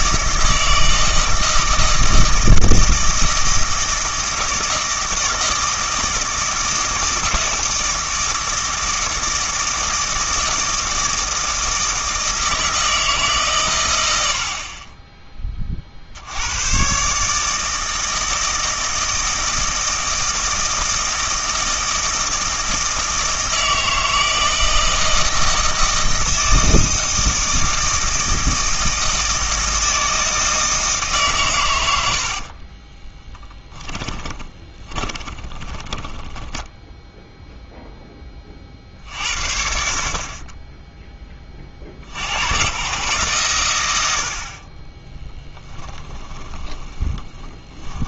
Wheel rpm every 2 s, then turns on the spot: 160, 160, 160, 160, 160, 160, 160, 30, 120, 160, 160, 160, 160, 160, 160, 160, 30, 20, 0, 50, 10, 110, 30, 20.
32-36 46-48